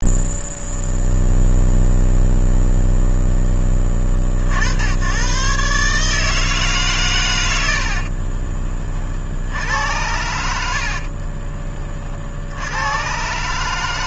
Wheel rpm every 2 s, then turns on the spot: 0, 0, 90, 140, 40, 60, 120.
10-12